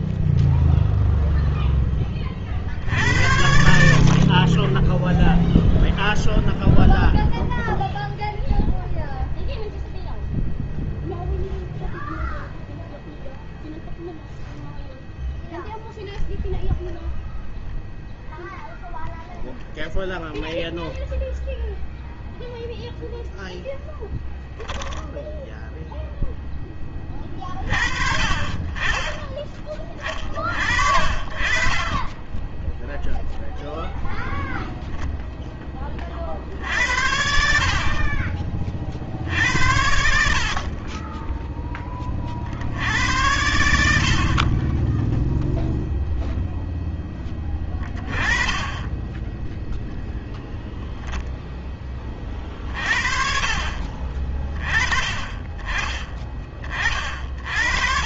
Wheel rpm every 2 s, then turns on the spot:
0, 30, 40, 0, 0, 0, 0, 0, 0, 0, 0, 0, 0, 0, 30, 30, 20, 0, 40, 40, 60, 40, 50, 0, 20, 10, 30, 30, 30.
32-34 44-46